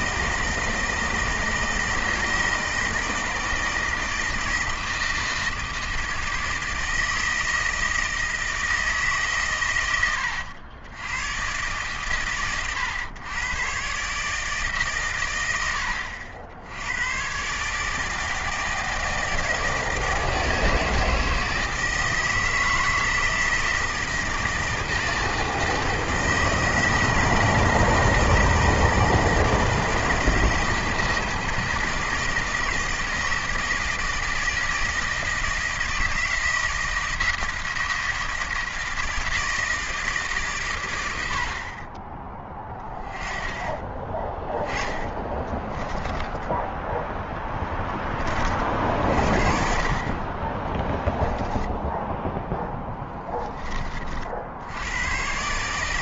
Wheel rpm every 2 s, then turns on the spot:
160, 160, 160, 160, 160, 90, 110, 150, 80, 160, 160, 160, 160, 160, 160, 160, 160, 160, 160, 160, 130, 10, 10, 10, 50, 20, 10, 70.
44-46 52-54